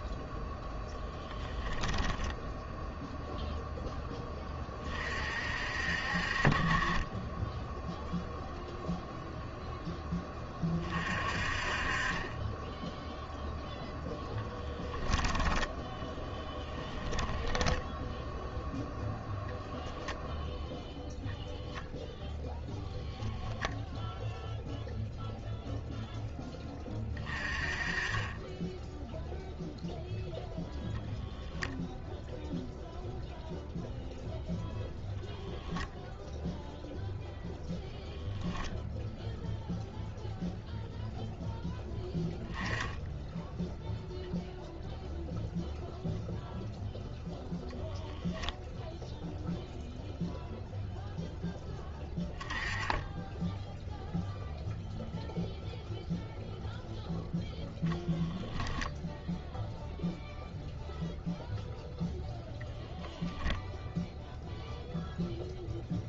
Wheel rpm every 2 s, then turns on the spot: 0, 0, 30, 20, 0, 30, 10, 10, 10, 0, 0, 0, 0, 20, 10, 0, 0, 0, 0, 0, 0, 10, 0, 0, 0, 0, 10, 0, 0, 0, 0, 0, 0.
16-18